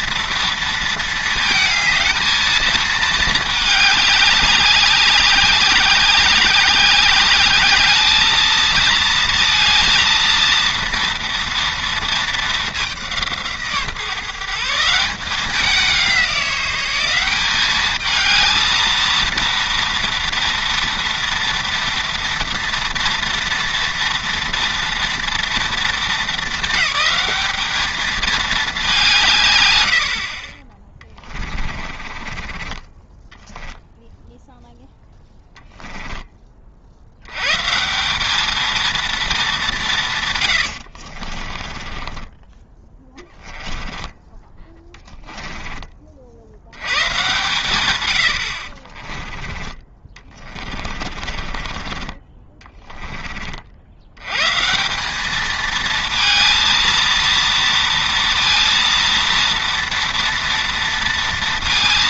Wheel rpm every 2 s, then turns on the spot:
230, 220, 190, 190, 230, 230, 200, 170, 190, 230, 230, 230, 230, 210, 200, 30, 20, 0, 50, 220, 80, 20, 10, 90, 30, 30, 20, 160, 230, 230, 230.
32-34 40-44 50-54